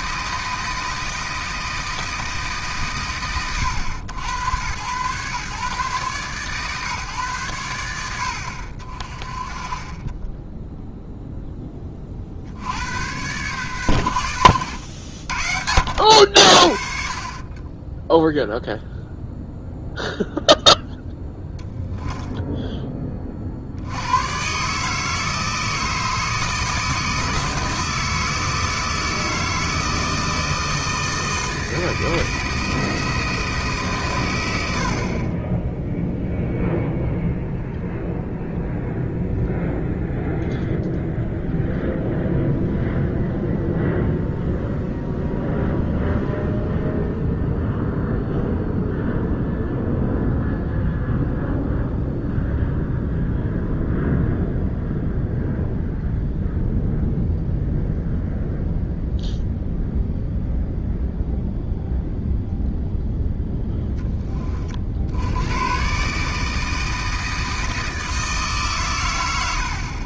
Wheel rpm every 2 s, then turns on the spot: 160, 140, 100, 130, 50, 10, 70, 90, 50, 0, 0, 10, 130, 160, 160, 160, 160, 90, 0, 0, 0, 0, 0, 0, 0, 0, 0, 0, 0, 0, 0, 0, 30, 160, 140.
10-12